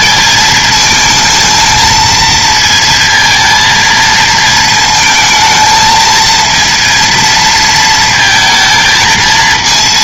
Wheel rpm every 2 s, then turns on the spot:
220, 230, 220, 230, 230.
none